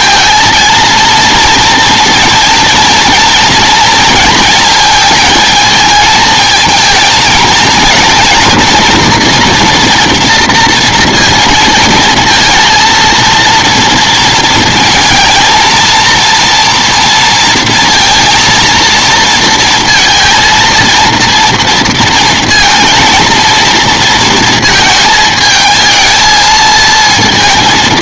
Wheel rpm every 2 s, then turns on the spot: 230, 230, 220, 230, 230, 230, 230, 230, 230, 230, 230, 230, 220, 230.
none